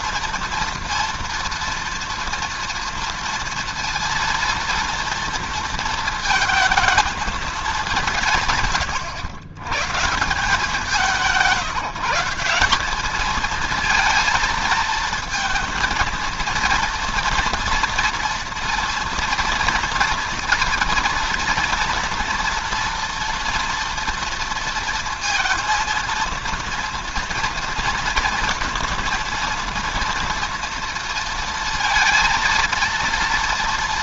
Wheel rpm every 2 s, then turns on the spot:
230, 230, 230, 220, 120, 160, 190, 230, 230, 230, 230, 240, 230, 230, 230, 230, 230.
none